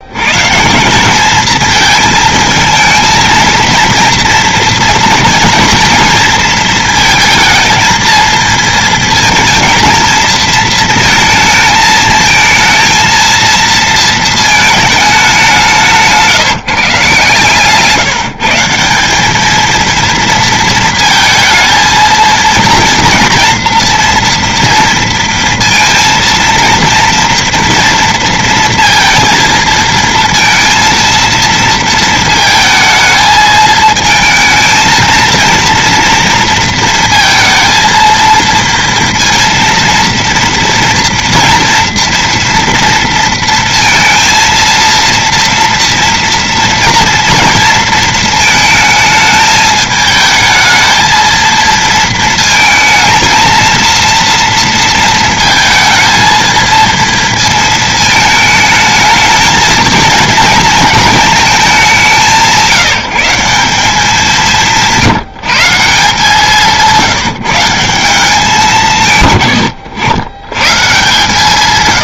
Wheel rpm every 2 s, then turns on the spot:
110, 220, 230, 240, 230, 230, 220, 220, 170, 150, 230, 230, 230, 230, 230, 230, 230, 220, 230, 230, 230, 230, 230, 230, 220, 220, 230, 230, 230, 220, 220, 190, 190, 170, 180, 100.
16-18